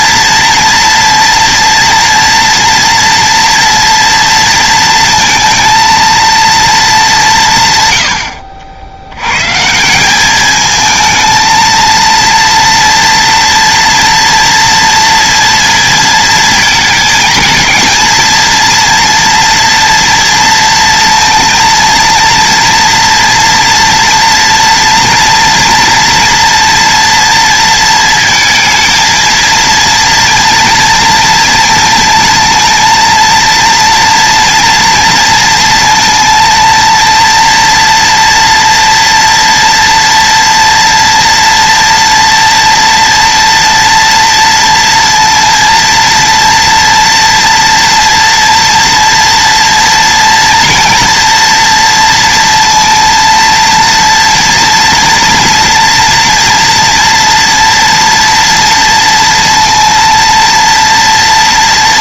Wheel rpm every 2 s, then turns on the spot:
240, 230, 230, 200, 80, 220, 230, 230, 230, 240, 230, 230, 240, 230, 230, 230, 230, 230, 230, 230, 230, 230, 230, 230, 230, 240, 230, 230, 230, 230, 230.
none